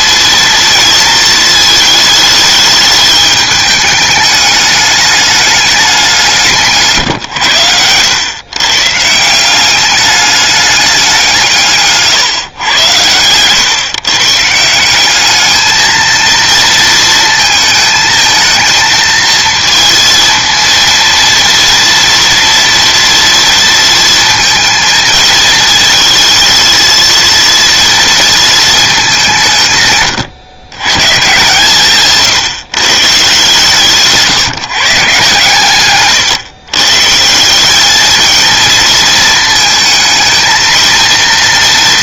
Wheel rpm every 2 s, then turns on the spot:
230, 210, 210, 160, 140, 200, 120, 180, 230, 220, 230, 230, 220, 220, 210, 130, 140, 150, 140, 230, 230.
6-8